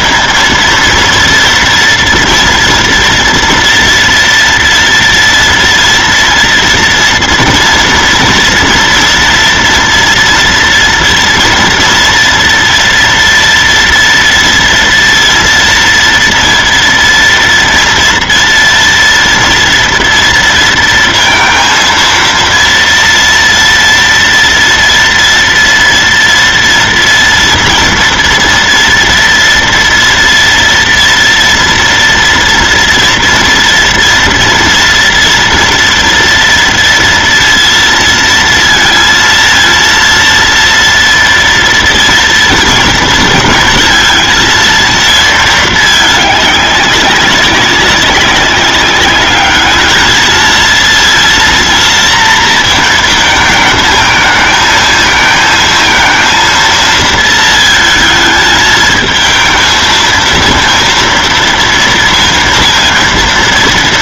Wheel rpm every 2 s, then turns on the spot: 230, 230, 230, 230, 230, 230, 230, 230, 230, 230, 230, 230, 230, 230, 230, 230, 240, 240, 230, 230, 230, 230, 230, 200, 200, 230, 230, 220, 230, 220, 230, 230.
none